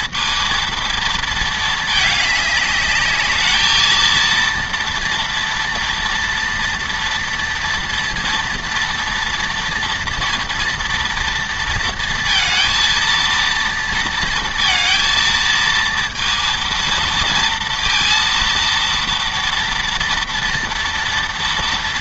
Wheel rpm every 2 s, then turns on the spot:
230, 210, 230, 230, 230, 230, 230, 230, 230, 230, 230.
none